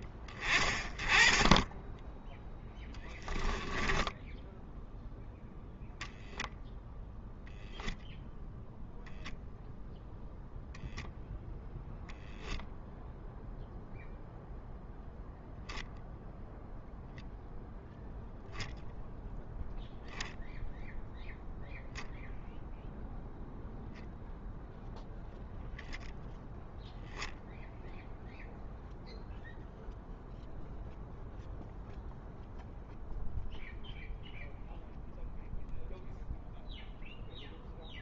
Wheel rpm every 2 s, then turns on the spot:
20, 10, 10, 0, 0, 0, 0, 0, 0, 0, 0, 0, 0, 0, 0, 0, 0, 0, 0.
none